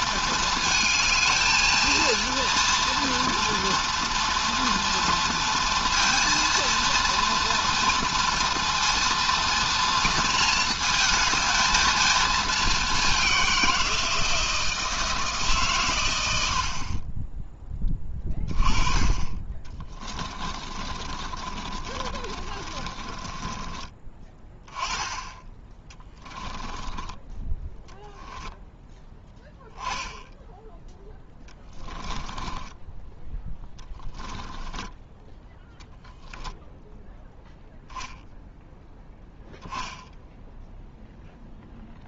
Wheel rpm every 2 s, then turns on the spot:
220, 230, 230, 230, 240, 230, 200, 160, 40, 20, 30, 30, 10, 10, 10, 10, 10, 10, 0, 0, 0.
16-18 20-24 26-28 34-36